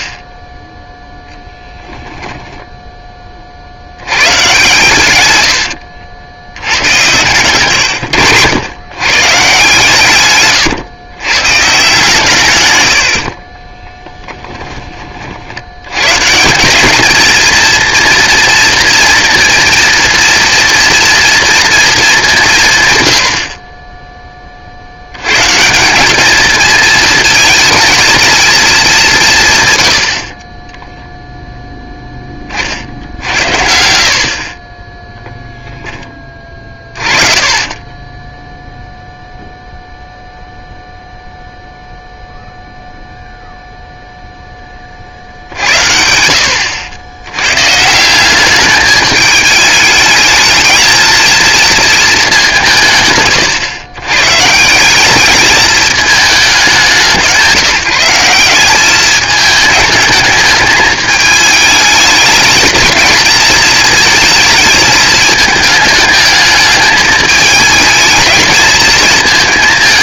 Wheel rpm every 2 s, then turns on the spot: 0, 20, 110, 120, 130, 120, 70, 50, 220, 230, 240, 100, 90, 220, 180, 0, 70, 20, 30, 0, 0, 0, 30, 90, 210, 220, 170, 160, 190, 190, 210, 220, 220, 210, 220.
4-6 32-38